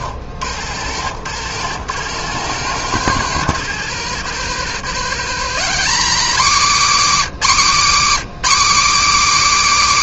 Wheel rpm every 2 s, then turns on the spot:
80, 120, 150, 250, 250.
none